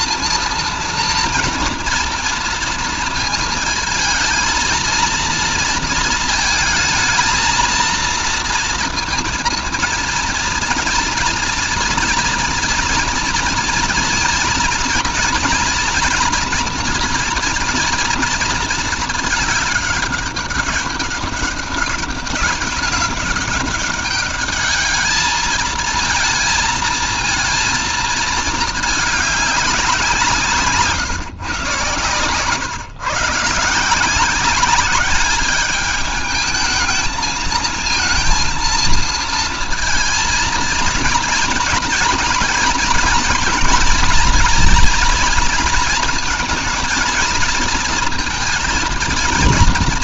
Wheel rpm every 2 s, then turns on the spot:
230, 230, 230, 220, 230, 230, 230, 230, 230, 220, 200, 200, 220, 230, 200, 140, 150, 210, 220, 230, 230, 230, 230, 230, 230.
none